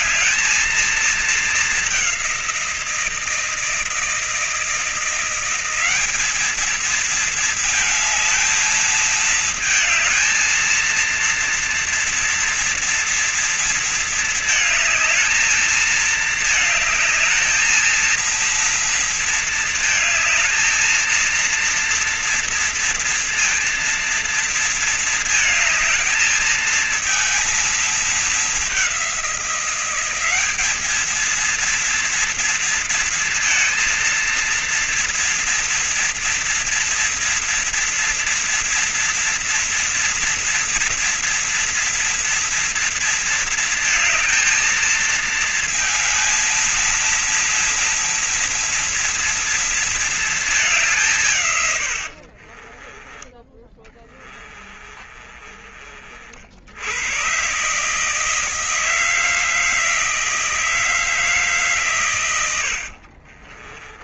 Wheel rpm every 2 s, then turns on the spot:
230, 190, 160, 210, 220, 230, 230, 220, 220, 230, 220, 230, 230, 220, 210, 200, 230, 230, 230, 240, 230, 230, 220, 230, 230, 220, 60, 40, 60, 160, 160, 100.
52-56 62-64